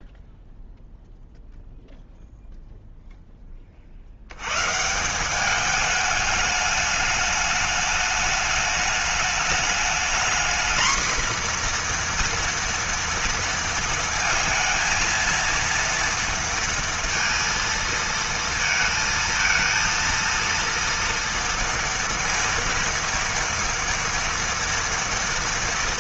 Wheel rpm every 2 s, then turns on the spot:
0, 10, 180, 210, 210, 240, 230, 230, 230, 230, 230, 230, 230.
none